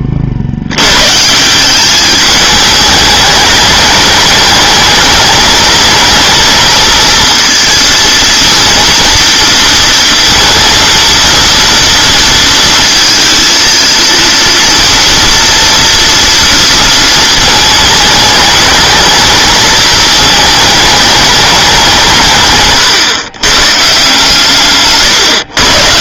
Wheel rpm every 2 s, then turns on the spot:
100, 210, 210, 230, 230, 230, 230, 230, 230, 220, 220, 130, 140.
none